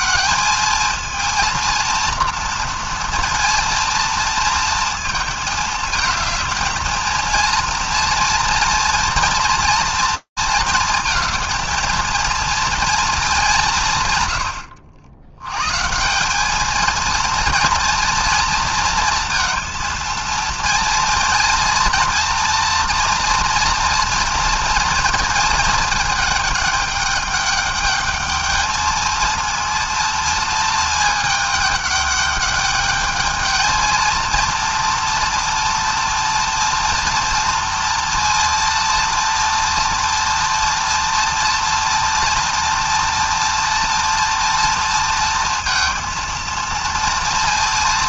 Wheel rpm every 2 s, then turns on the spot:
220, 240, 230, 220, 230, 230, 220, 80, 210, 230, 230, 230, 230, 210, 220, 230, 210, 230, 230, 230, 240, 240, 230, 230.
none